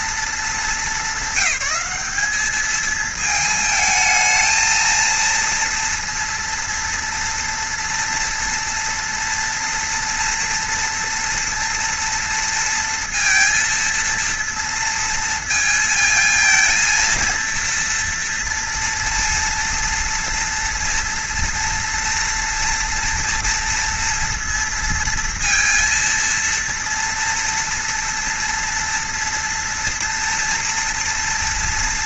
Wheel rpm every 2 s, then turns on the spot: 210, 220, 230, 230, 240, 230, 230, 230, 230, 230, 230, 230, 230, 230, 230, 240.
none